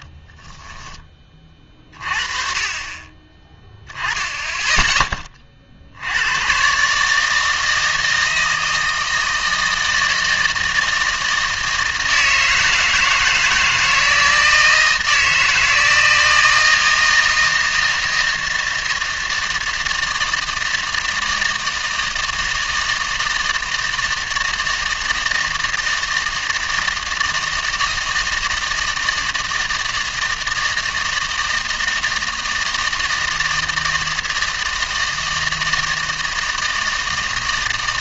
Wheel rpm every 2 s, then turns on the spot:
0, 30, 10, 120, 160, 160, 160, 160, 160, 160, 160, 160, 160, 160, 160, 160, 160, 160, 160.
none